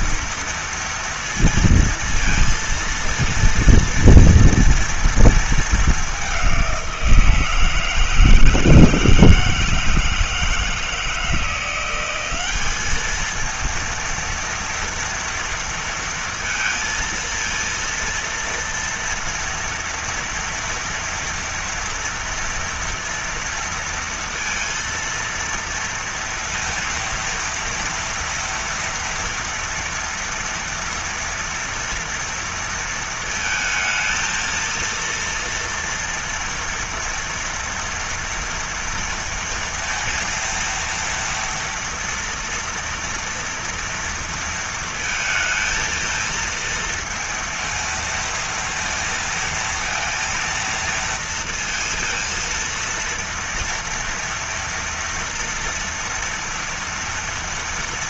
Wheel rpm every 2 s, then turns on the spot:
230, 230, 230, 200, 160, 160, 190, 230, 230, 230, 230, 230, 230, 230, 230, 230, 230, 230, 230, 230, 230, 230, 230, 230, 230, 230, 230, 230, 230.
none